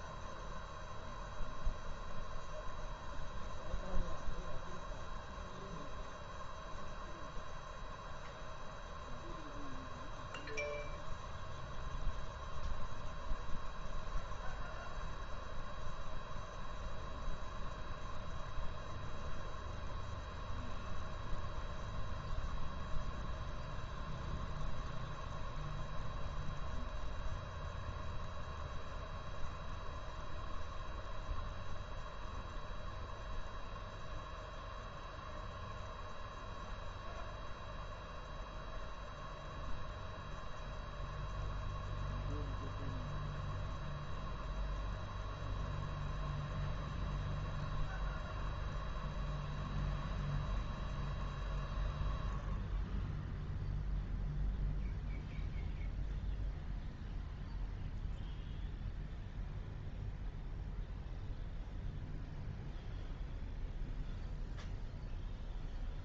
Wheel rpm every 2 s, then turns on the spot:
0, 0, 0, 0, 0, 0, 0, 0, 0, 0, 0, 0, 0, 0, 0, 0, 0, 0, 0, 0, 0, 0, 0, 0, 0, 0, 0, 0, 0, 0, 0, 0, 0.
none